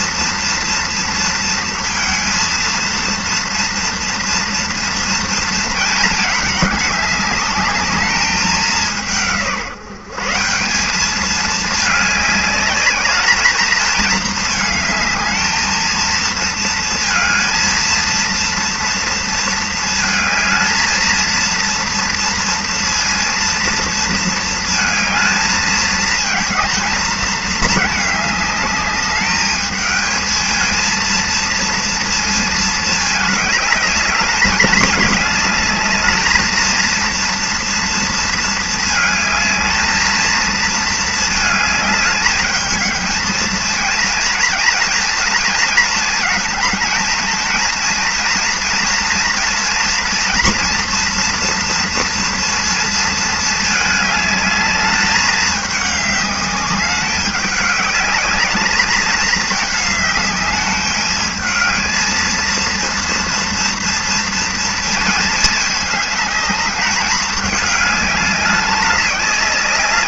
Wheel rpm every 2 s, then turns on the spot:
230, 230, 230, 210, 200, 180, 210, 220, 230, 230, 220, 230, 230, 220, 210, 220, 220, 210, 220, 230, 220, 210, 230, 220, 230, 240, 230, 210, 200, 210, 210, 230, 230, 200, 200.
none